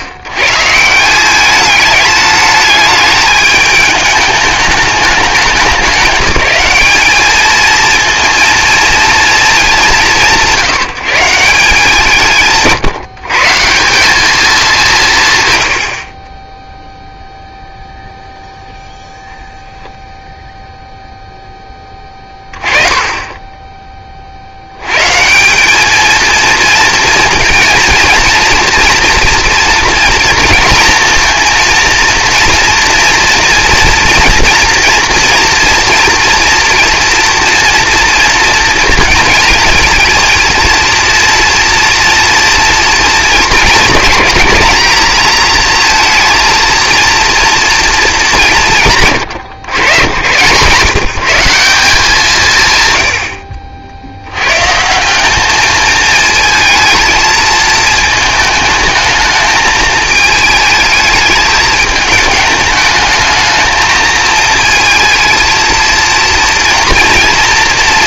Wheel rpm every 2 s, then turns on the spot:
120, 210, 210, 210, 230, 150, 150, 180, 0, 0, 0, 20, 90, 230, 240, 230, 240, 230, 230, 230, 230, 230, 220, 230, 130, 150, 70, 150, 220, 220, 220, 210, 220, 230.
none